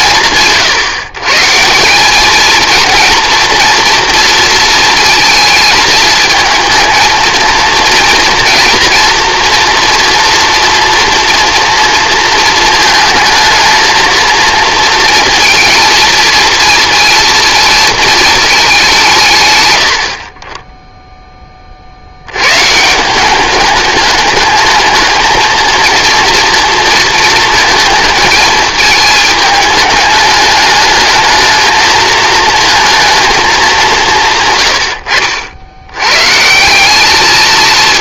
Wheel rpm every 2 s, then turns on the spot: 140, 230, 230, 230, 240, 230, 220, 230, 230, 190, 10, 150, 220, 230, 220, 210, 230, 100, 180.
none